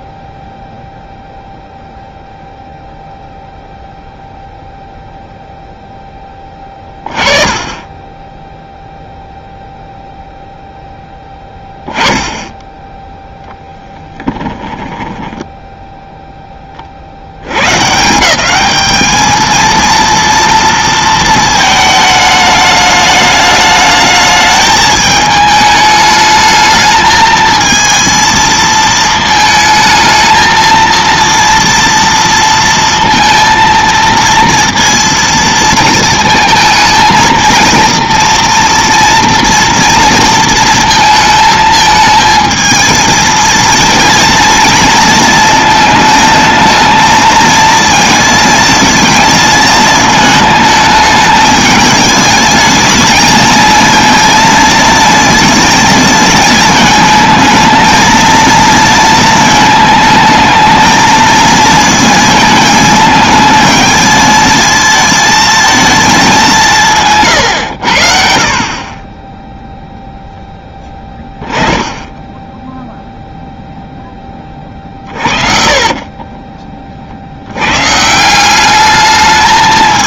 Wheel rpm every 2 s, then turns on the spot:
0, 0, 0, 20, 0, 0, 10, 10, 20, 200, 230, 210, 210, 220, 220, 230, 230, 230, 220, 230, 230, 220, 230, 220, 220, 220, 220, 230, 220, 230, 220, 220, 220, 180, 40, 0, 0, 30, 20, 200.
14-16 74-76